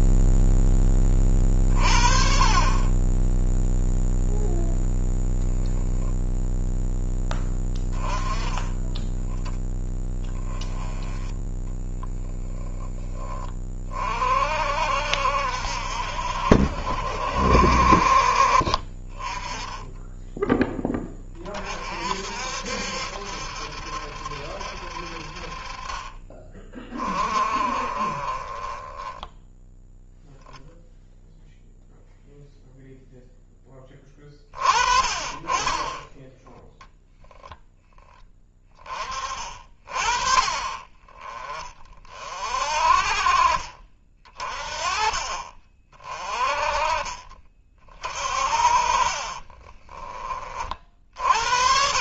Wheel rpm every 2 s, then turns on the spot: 10, 40, 0, 0, 10, 10, 20, 50, 60, 40, 10, 60, 70, 20, 20, 0, 0, 30, 10, 20, 40, 40, 30, 30, 50, 40.
none